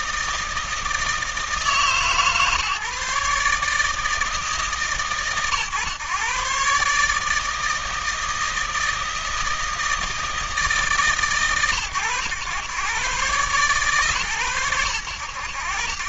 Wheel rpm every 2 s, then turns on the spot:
160, 150, 140, 140, 160, 140, 120, 100.
none